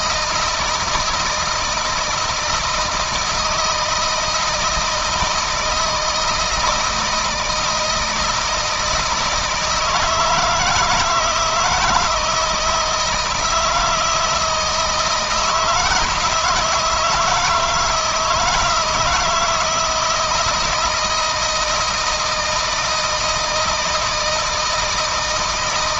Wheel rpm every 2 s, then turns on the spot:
160, 160, 160, 160, 160, 160, 160, 170, 160, 160, 160, 160, 160.
none